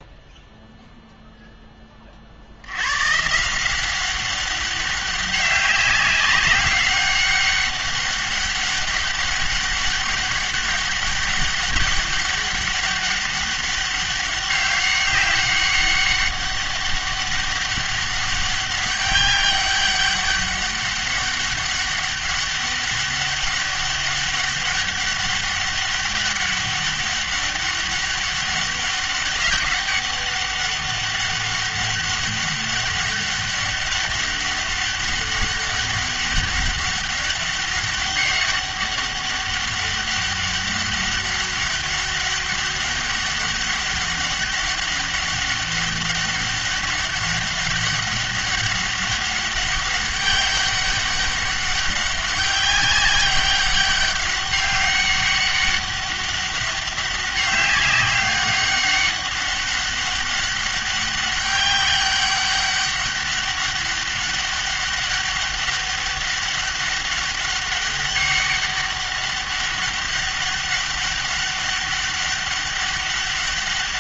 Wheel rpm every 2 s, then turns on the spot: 0, 90, 200, 190, 200, 200, 200, 200, 200, 200, 200, 200, 200, 200, 200, 200, 200, 200, 200, 200, 200, 200, 200, 200, 200, 200, 190, 200, 190, 200, 200, 200, 200, 200, 200, 200, 200.
none